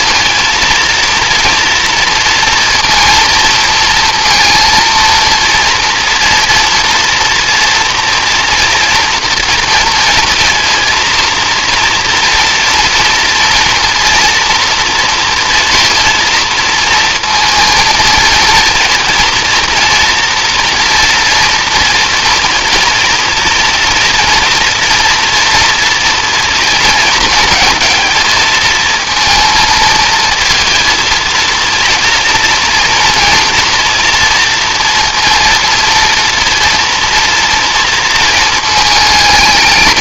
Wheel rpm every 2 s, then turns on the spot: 230, 230, 230, 230, 240, 230, 230, 230, 230, 230, 240, 240, 230, 230, 230, 230, 230, 230, 230, 220.
none